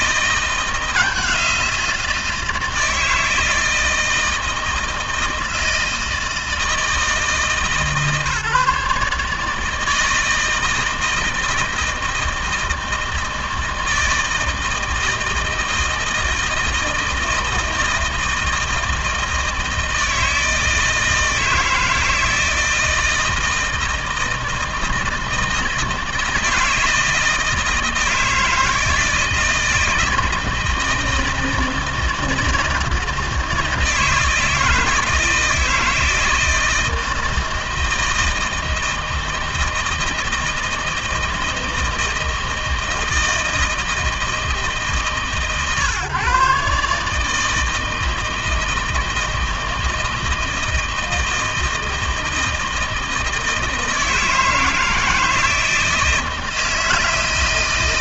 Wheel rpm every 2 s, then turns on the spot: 170, 160, 160, 160, 150, 160, 160, 160, 160, 160, 160, 160, 160, 160, 160, 160, 160, 160, 160, 160, 160, 160, 150, 140, 160, 160, 160, 160, 160.
none